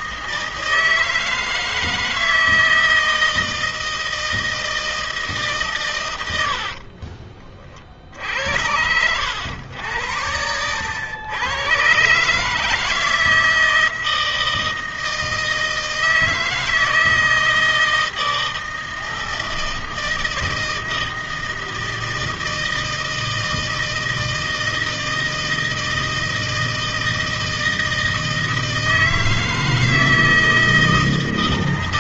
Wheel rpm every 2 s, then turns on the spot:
160, 160, 160, 70, 80, 90, 150, 160, 160, 160, 160, 160, 160, 160, 160, 160.
6-8